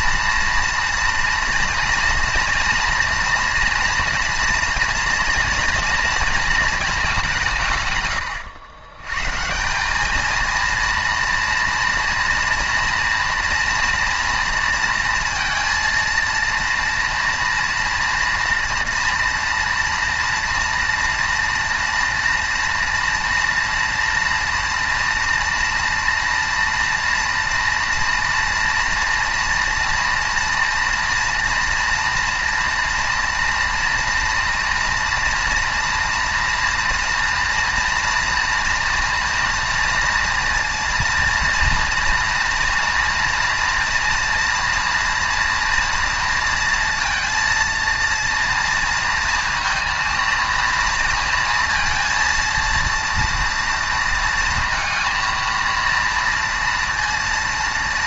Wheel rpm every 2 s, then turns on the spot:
230, 230, 240, 230, 110, 220, 230, 230, 230, 230, 230, 230, 230, 230, 230, 230, 230, 230, 230, 240, 230, 240, 230, 230, 230, 230, 230, 230, 230.
none